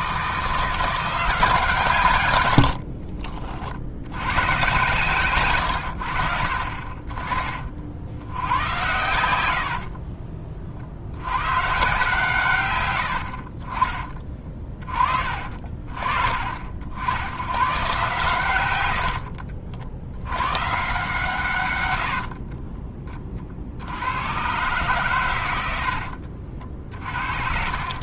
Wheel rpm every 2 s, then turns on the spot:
170, 70, 140, 40, 100, 50, 110, 30, 70, 110, 120, 20, 120, 50.
2-4 26-28